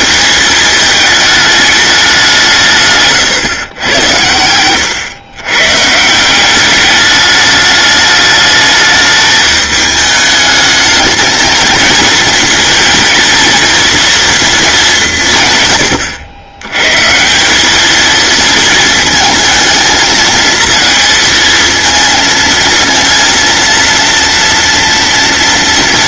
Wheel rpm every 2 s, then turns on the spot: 220, 160, 100, 200, 210, 220, 230, 220, 110, 220, 220, 230, 230.
none